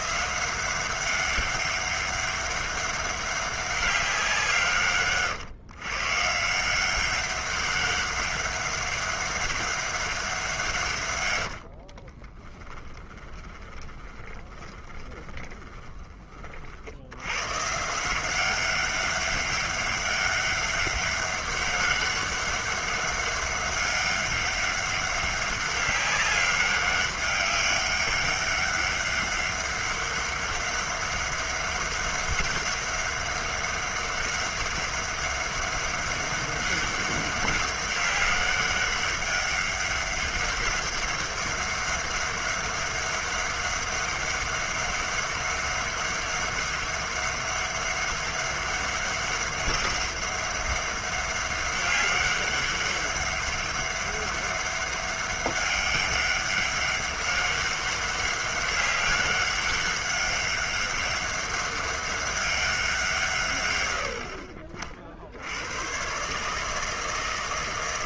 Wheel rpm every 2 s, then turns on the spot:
190, 200, 170, 160, 200, 180, 20, 20, 40, 190, 200, 200, 200, 200, 200, 200, 200, 200, 200, 200, 200, 200, 200, 200, 200, 200, 200, 200, 200, 200, 200, 200, 60, 150.
12-16